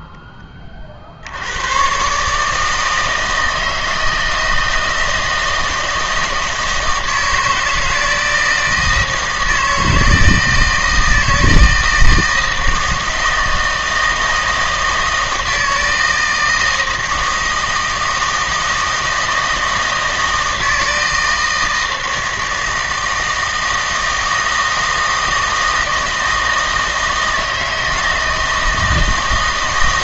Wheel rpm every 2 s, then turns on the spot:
30, 160, 160, 160, 160, 160, 160, 160, 160, 160, 160, 160, 160, 160, 160.
none